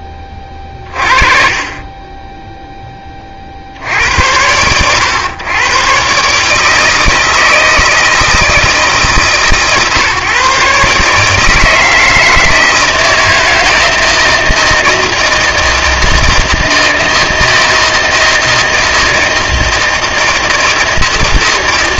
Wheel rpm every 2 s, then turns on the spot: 30, 10, 90, 150, 150, 140, 160, 160, 160, 160, 160.
none